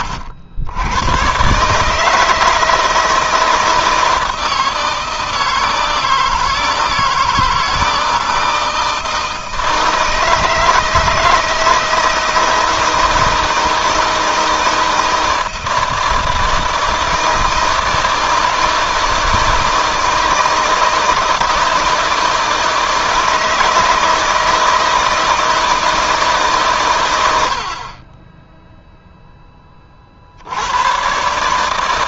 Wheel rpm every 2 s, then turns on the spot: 100, 160, 160, 160, 160, 160, 160, 160, 160, 160, 160, 160, 160, 120, 0, 120.
none